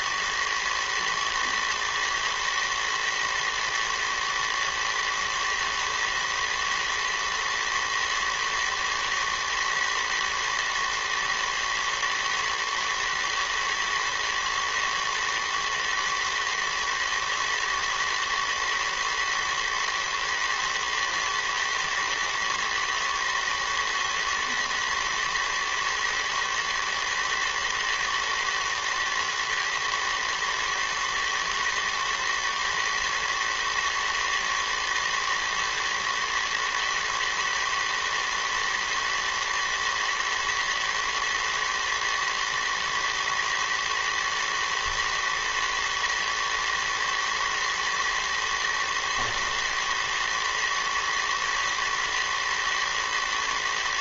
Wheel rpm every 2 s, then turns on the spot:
50, 110, 110, 110, 110, 120, 120, 110, 110, 110, 110, 110, 110, 110, 110, 110, 110, 110, 110, 110, 110, 110, 110, 110, 110, 110, 110.
none